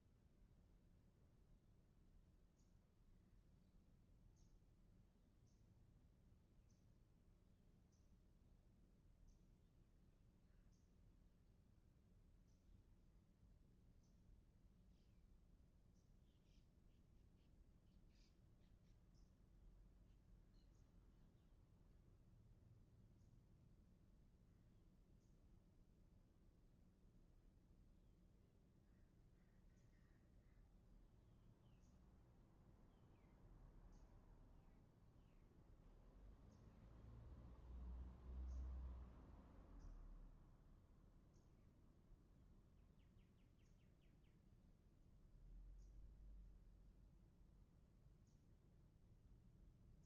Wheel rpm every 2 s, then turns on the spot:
0, 0, 0, 0, 0, 0, 0, 0, 0, 0, 0, 0, 0, 0, 0, 0, 0, 0, 0, 0, 0, 0, 0, 0, 0.
none